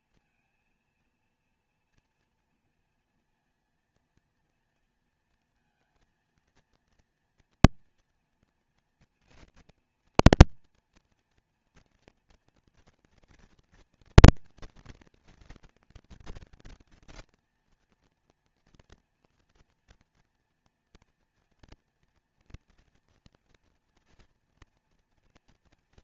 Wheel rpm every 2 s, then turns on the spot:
230, 230, 230, 230, 230, 230, 230, 240, 230, 230, 230, 230, 230.
none